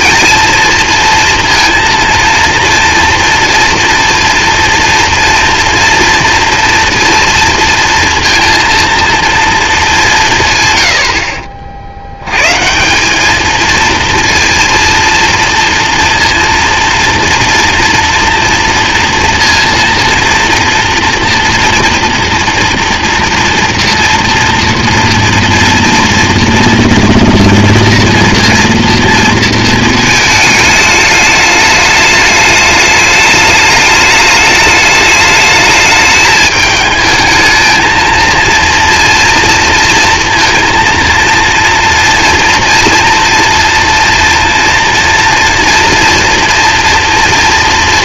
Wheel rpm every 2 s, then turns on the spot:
230, 230, 240, 240, 230, 100, 140, 230, 230, 240, 230, 230, 230, 240, 230, 220, 210, 210, 220, 230, 230, 230, 230, 230.
none